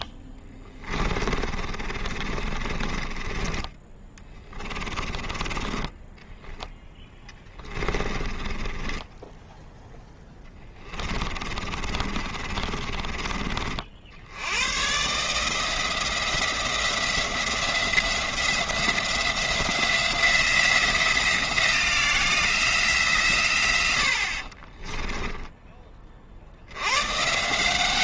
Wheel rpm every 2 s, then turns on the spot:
20, 30, 30, 10, 20, 10, 30, 110, 170, 180, 170, 170, 30, 70.
0-14 24-26